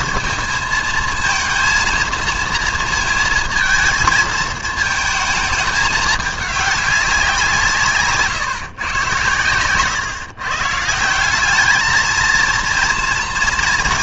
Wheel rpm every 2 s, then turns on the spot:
230, 220, 220, 200, 140, 140, 230.
none